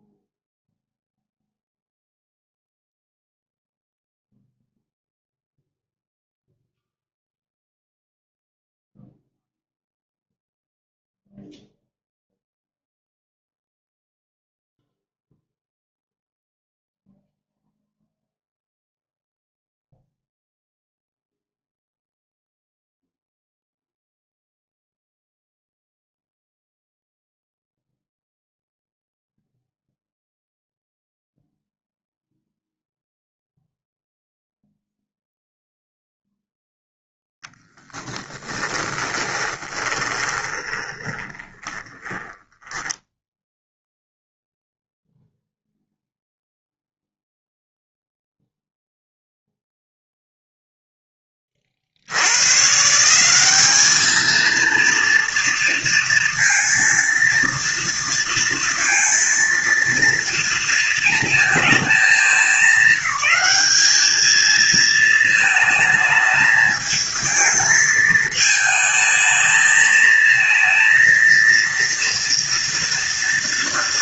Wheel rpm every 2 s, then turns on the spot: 0, 0, 0, 0, 0, 0, 0, 0, 0, 0, 0, 0, 0, 0, 0, 0, 0, 0, 0, 30, 20, 10, 0, 0, 0, 0, 150, 230, 230, 230, 230, 210, 220, 220, 220, 230, 240.
38-44